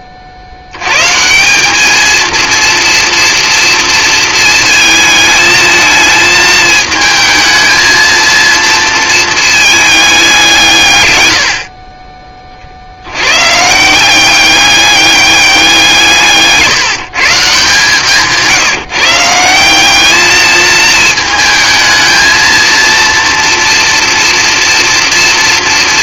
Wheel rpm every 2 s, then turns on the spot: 90, 230, 220, 220, 230, 150, 70, 200, 180, 160, 220, 230, 230.
none